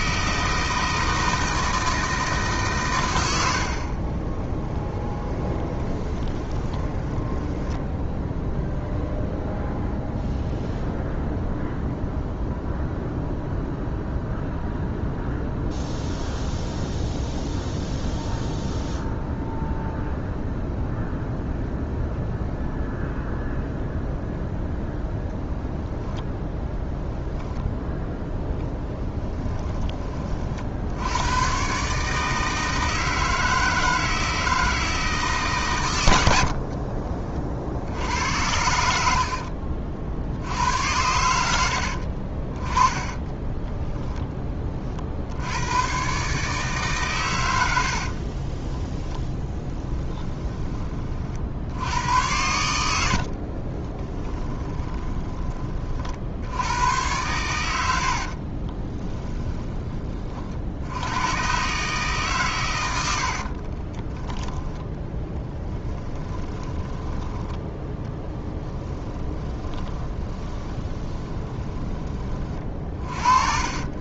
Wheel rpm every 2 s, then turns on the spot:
160, 120, 10, 20, 0, 0, 0, 0, 0, 0, 0, 0, 0, 0, 10, 70, 160, 160, 40, 70, 80, 20, 40, 140, 20, 30, 90, 20, 100, 20, 70, 100, 20, 10, 10, 20, 30.
4-8 28-30 36-38 42-44 48-50 52-56 58-60 64-74